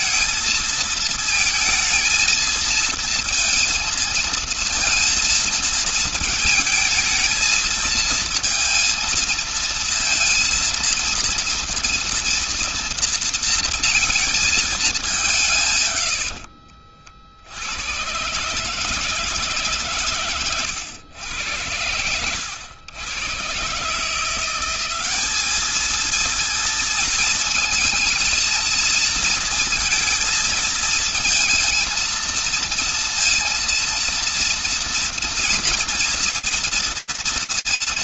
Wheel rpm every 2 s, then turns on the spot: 220, 220, 230, 220, 230, 230, 230, 220, 80, 140, 120, 90, 170, 220, 230, 230, 230, 230, 230.
16-18